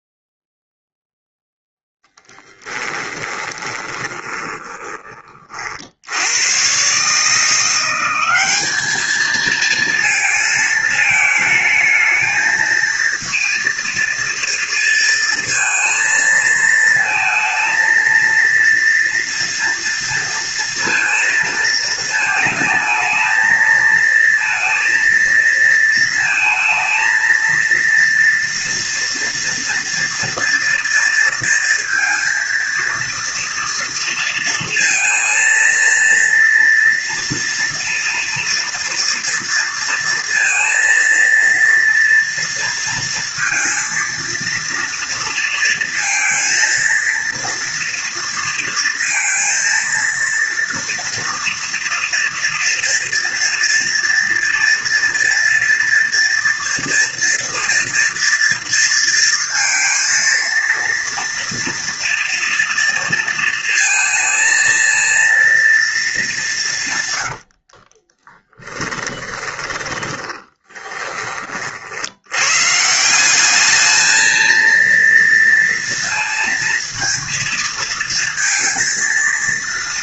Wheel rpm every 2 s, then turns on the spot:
0, 10, 10, 100, 200, 230, 230, 230, 230, 230, 230, 220, 230, 230, 230, 230, 230, 230, 230, 230, 230, 230, 230, 230, 230, 230, 230, 230, 230, 230, 230, 230, 230, 190, 30, 20, 110, 220, 230, 230.
2-6 68-72